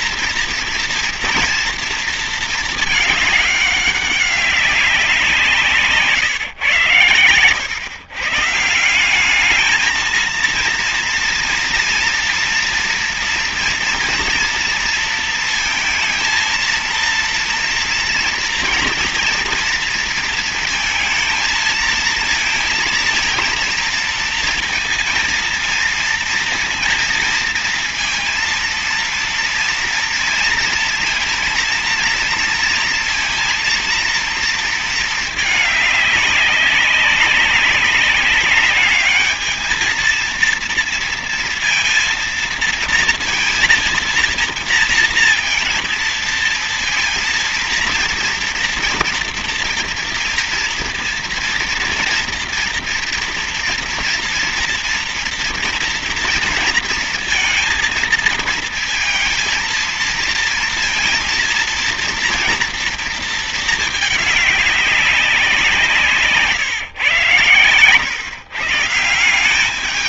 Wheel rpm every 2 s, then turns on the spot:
230, 220, 190, 120, 160, 230, 230, 230, 230, 230, 230, 230, 230, 230, 230, 230, 230, 220, 200, 200, 230, 230, 230, 230, 230, 230, 230, 240, 230, 220, 230, 230, 200, 140, 130.
none